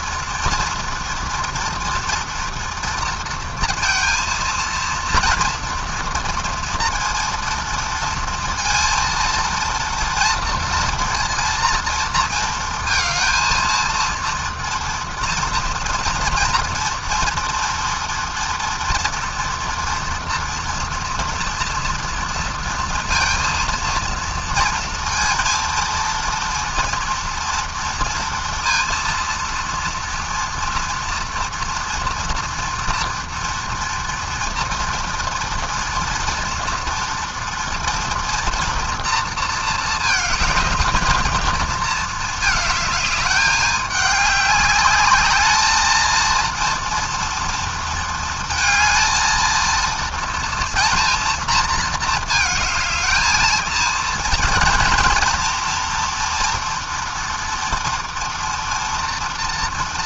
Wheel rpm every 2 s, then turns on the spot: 230, 230, 230, 230, 230, 230, 230, 230, 230, 230, 230, 230, 230, 230, 230, 240, 230, 230, 230, 230, 220, 210, 210, 230, 230, 230, 220, 230, 230, 230.
none